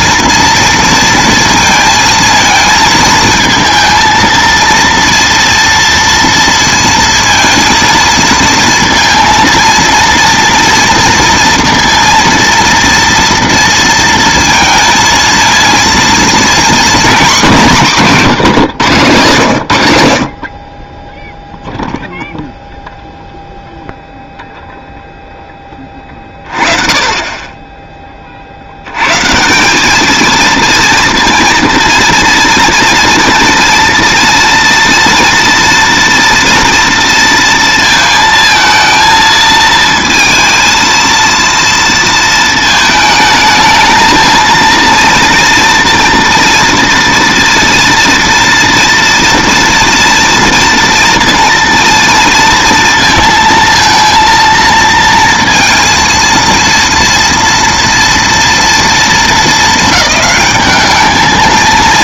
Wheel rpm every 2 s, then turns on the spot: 230, 230, 230, 230, 230, 230, 230, 230, 240, 140, 30, 0, 0, 30, 70, 230, 230, 240, 240, 230, 230, 220, 230, 230, 230, 230, 230, 230, 230, 230, 210.
none